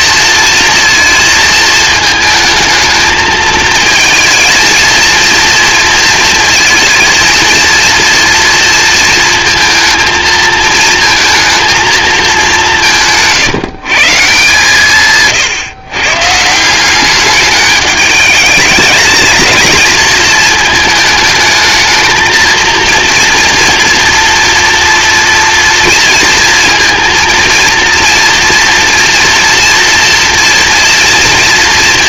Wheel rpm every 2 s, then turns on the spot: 230, 220, 230, 230, 230, 220, 170, 140, 180, 210, 220, 230, 230, 230, 230, 230.
none